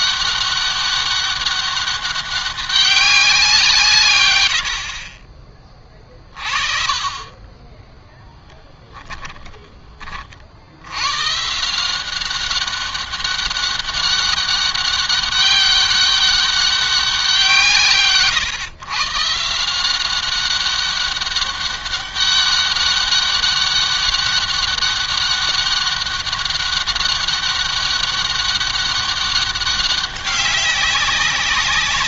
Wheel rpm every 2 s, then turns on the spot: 200, 200, 70, 30, 10, 110, 200, 200, 190, 140, 200, 200, 200, 200, 200, 190.
8-10